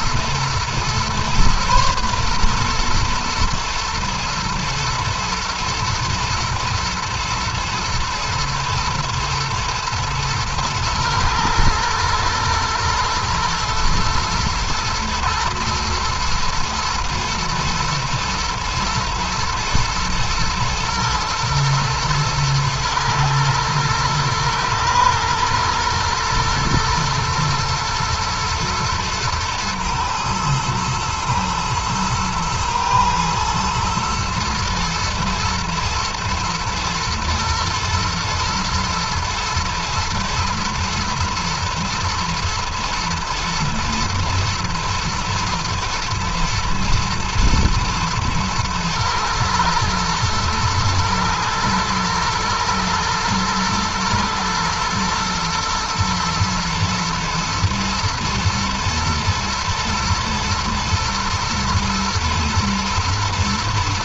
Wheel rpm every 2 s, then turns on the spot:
120, 120, 110, 120, 120, 110, 120, 120, 120, 120, 110, 110, 120, 120, 110, 110, 110, 120, 110, 110, 120, 120, 110, 120, 110, 110, 120, 110, 110, 120, 120, 120.
none